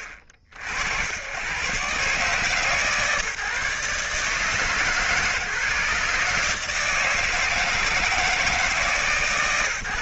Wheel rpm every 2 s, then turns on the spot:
70, 140, 150, 160, 150.
none